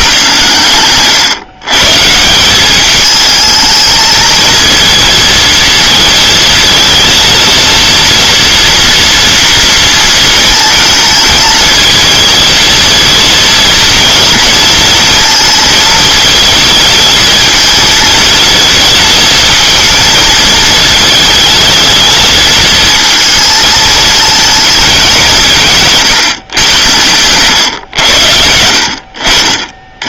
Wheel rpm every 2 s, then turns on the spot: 120, 210, 230, 230, 230, 230, 220, 230, 220, 220, 220, 220, 200, 110, 70.
none